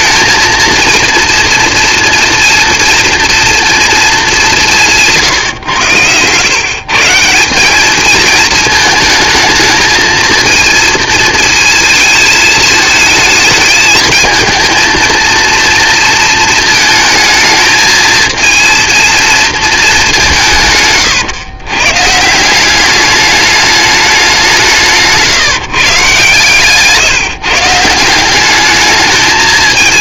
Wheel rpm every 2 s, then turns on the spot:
230, 230, 160, 160, 220, 230, 220, 230, 220, 230, 110, 200, 150, 150, 210.
none